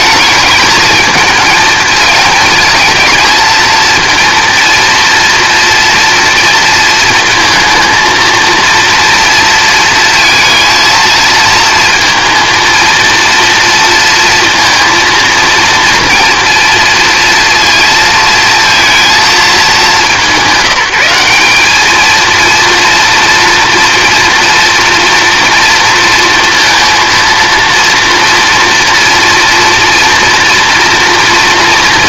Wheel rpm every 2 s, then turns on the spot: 220, 220, 230, 230, 230, 230, 230, 230, 230, 230, 180, 230, 230, 230, 230, 230.
none